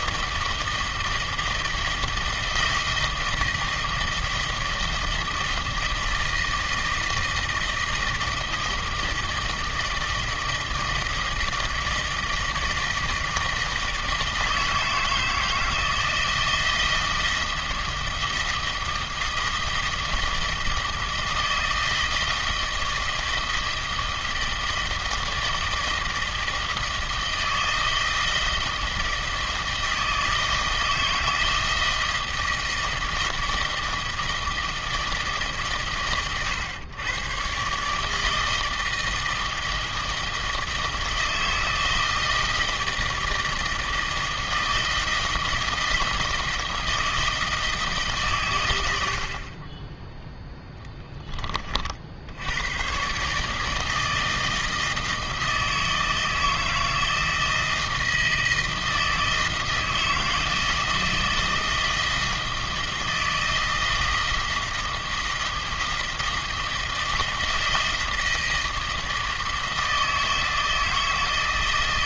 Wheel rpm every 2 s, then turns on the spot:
160, 160, 160, 160, 160, 160, 160, 160, 160, 160, 160, 160, 160, 160, 160, 160, 160, 160, 110, 160, 160, 160, 160, 160, 100, 10, 110, 160, 160, 160, 160, 160, 160, 160, 160, 160.
none